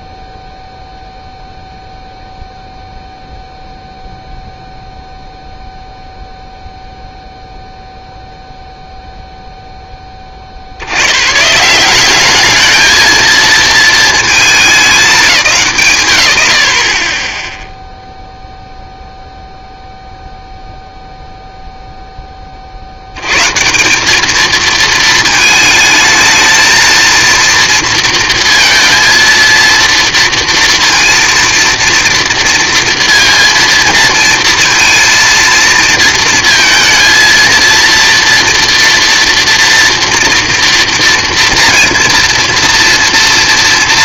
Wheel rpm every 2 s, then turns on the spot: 0, 0, 0, 0, 0, 80, 210, 210, 80, 0, 0, 50, 220, 230, 230, 230, 230, 230, 230, 230, 230, 230.
none